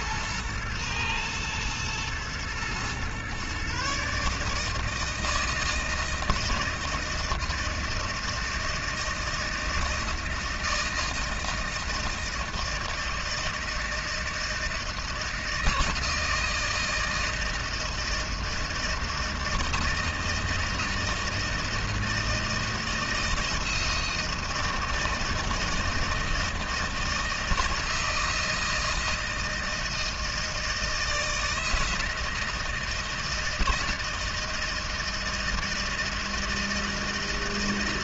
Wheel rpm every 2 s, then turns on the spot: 110, 120, 150, 160, 160, 160, 160, 160, 160, 160, 160, 160, 160, 160, 160, 160, 160, 160, 160.
none